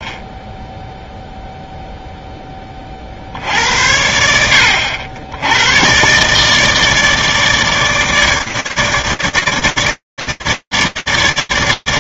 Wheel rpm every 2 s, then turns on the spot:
10, 20, 80, 150, 150, 100.
none